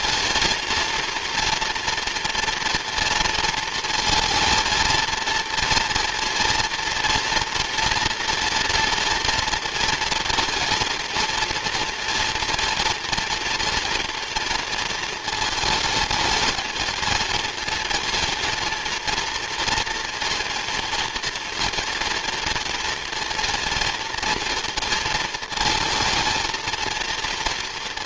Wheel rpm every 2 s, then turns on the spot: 230, 230, 230, 230, 230, 230, 230, 230, 220, 230, 230, 230, 230, 230.
none